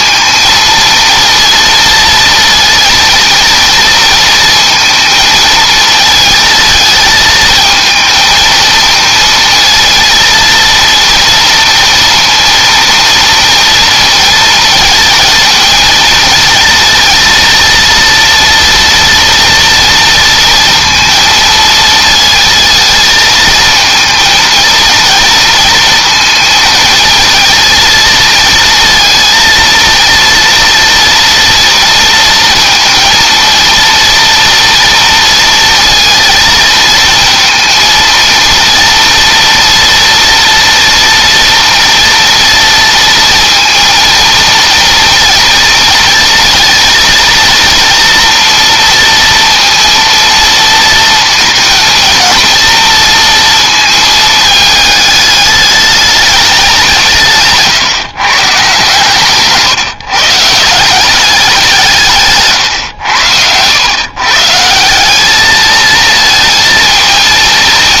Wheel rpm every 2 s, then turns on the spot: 230, 230, 230, 220, 220, 230, 230, 220, 230, 230, 230, 230, 230, 230, 230, 230, 230, 230, 230, 230, 230, 230, 230, 220, 230, 220, 230, 210, 170, 150, 180, 110, 170, 220.
none